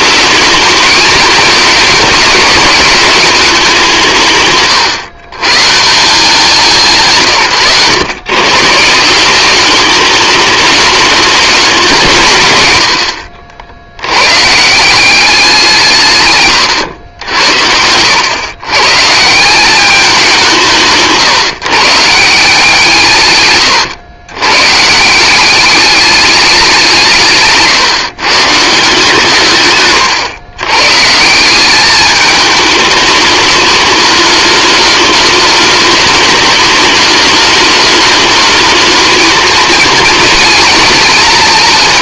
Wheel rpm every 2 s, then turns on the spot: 210, 210, 140, 140, 160, 210, 100, 170, 100, 140, 140, 160, 150, 180, 150, 140, 210, 210, 210, 220, 230.
none